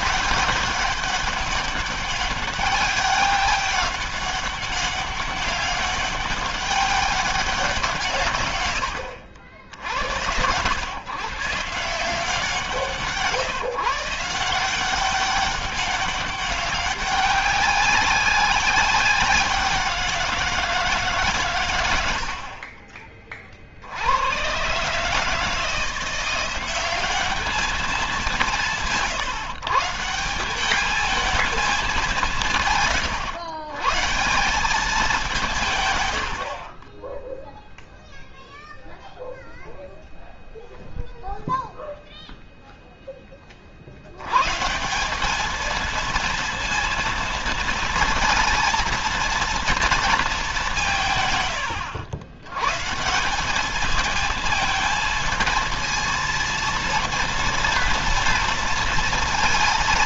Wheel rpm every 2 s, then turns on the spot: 190, 200, 200, 200, 100, 110, 170, 180, 200, 190, 160, 30, 130, 190, 160, 190, 150, 190, 30, 0, 0, 0, 160, 230, 230, 170, 120, 220, 230, 230.
none